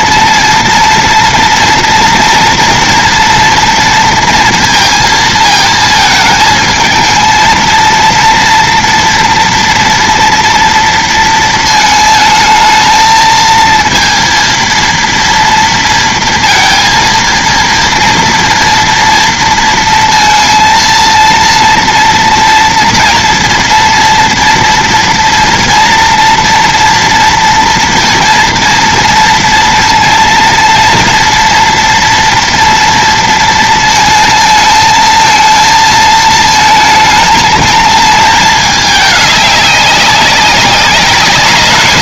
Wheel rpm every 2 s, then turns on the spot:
230, 230, 230, 220, 230, 240, 220, 230, 230, 230, 230, 230, 240, 240, 230, 230, 230, 220, 220, 220, 200.
none